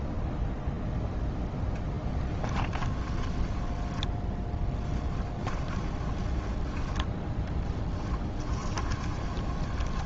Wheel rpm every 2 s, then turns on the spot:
0, 20, 10, 20, 20.
2-6 8-10